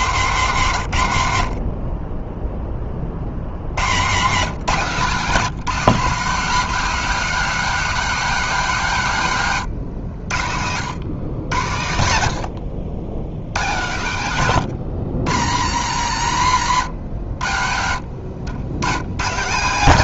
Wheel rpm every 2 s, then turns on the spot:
80, 160, 190, 100, 100, 100, 130, 70, 140, 180.
6-8